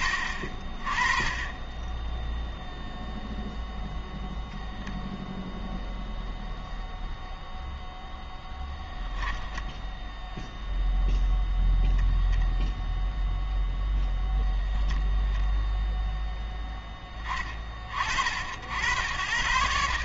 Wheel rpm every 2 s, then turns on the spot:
20, 0, 0, 0, 10, 0, 0, 0, 10, 70.
8-10